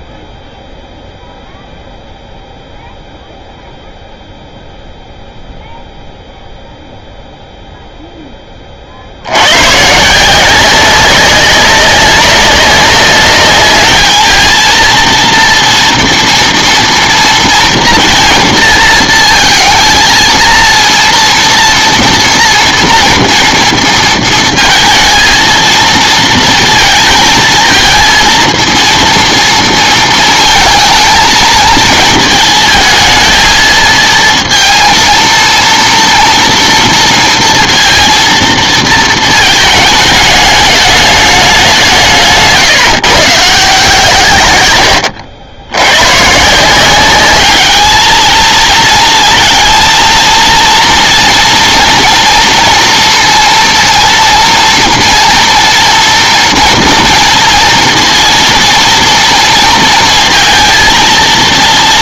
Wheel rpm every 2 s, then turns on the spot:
0, 0, 0, 0, 20, 180, 200, 230, 240, 230, 230, 230, 230, 230, 230, 220, 220, 230, 230, 230, 210, 160, 110, 160, 230, 230, 230, 230, 230, 230, 230.
none